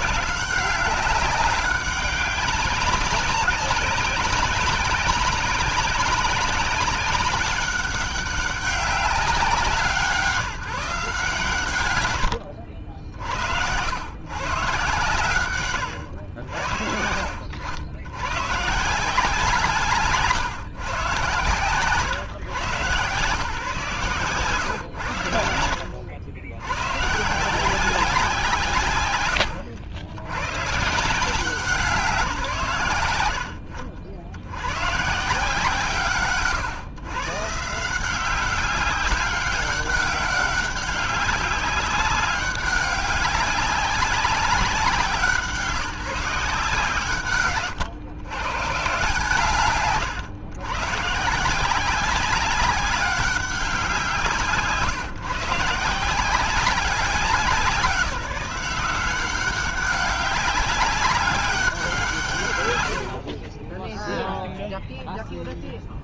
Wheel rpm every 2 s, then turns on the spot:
190, 190, 190, 200, 190, 160, 70, 130, 60, 160, 130, 120, 120, 110, 120, 140, 110, 130, 130, 190, 190, 190, 180, 160, 140, 130, 190, 150, 190, 180, 190, 90, 0.
none